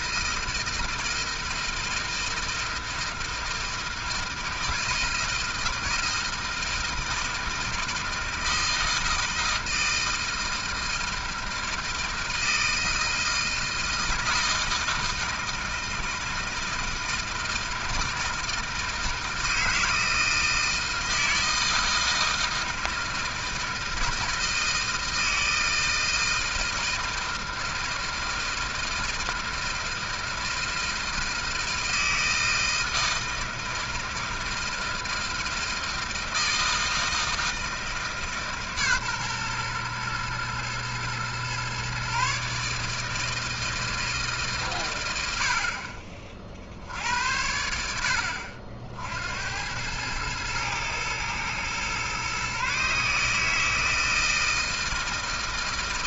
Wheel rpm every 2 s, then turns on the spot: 160, 160, 160, 160, 160, 160, 160, 160, 160, 160, 160, 160, 160, 160, 160, 160, 160, 160, 160, 150, 120, 140, 140, 50, 60, 110, 140, 160.
none